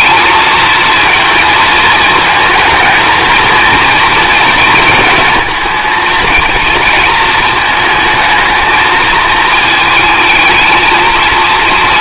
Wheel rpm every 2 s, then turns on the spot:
230, 220, 220, 230, 220, 220.
none